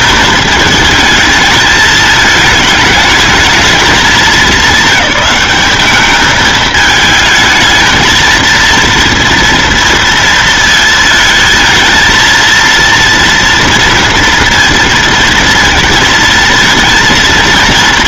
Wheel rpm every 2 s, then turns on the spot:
220, 220, 200, 220, 230, 220, 230, 230, 230.
none